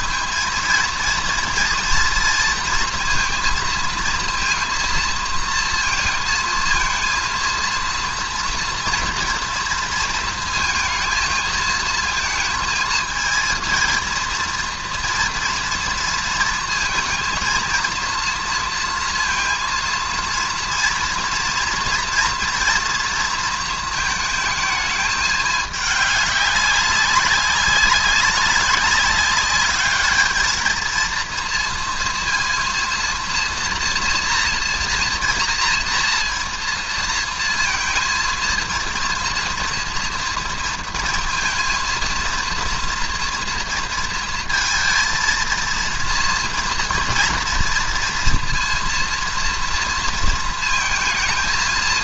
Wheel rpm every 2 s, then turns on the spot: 220, 230, 230, 230, 230, 220, 230, 230, 230, 230, 230, 230, 220, 200, 200, 220, 230, 230, 230, 230, 230, 230, 230, 230, 230, 230.
none